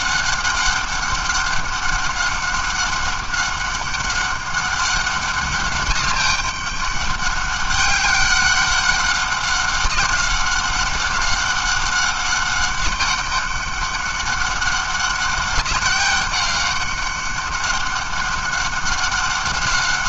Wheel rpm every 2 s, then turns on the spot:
200, 200, 200, 200, 190, 190, 200, 200, 200, 200.
none